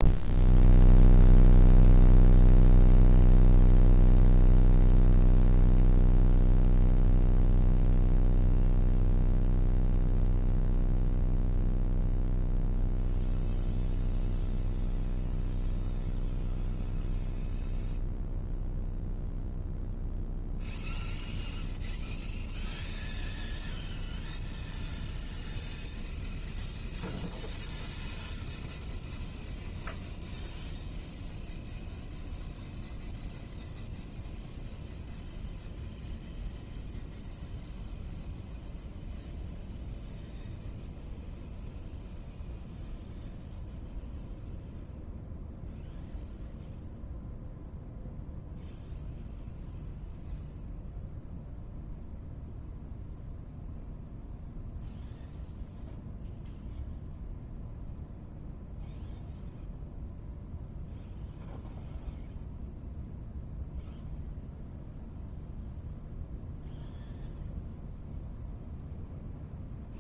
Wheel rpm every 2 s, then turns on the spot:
0, 0, 0, 0, 0, 0, 0, 0, 0, 0, 0, 0, 0, 0, 0, 0, 0, 0, 0, 0, 0, 0, 0, 0, 0, 0, 0, 0, 0, 0, 0, 0, 0, 0, 0.
none